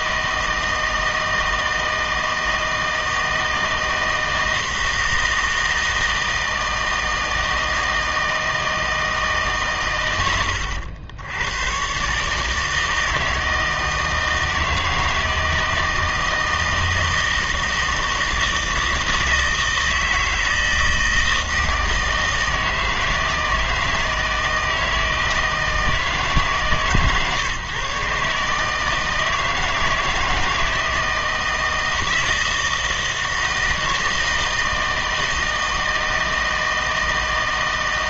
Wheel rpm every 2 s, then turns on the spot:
160, 160, 160, 160, 160, 100, 160, 160, 160, 160, 160, 160, 160, 150, 150, 160, 160, 160, 160.
none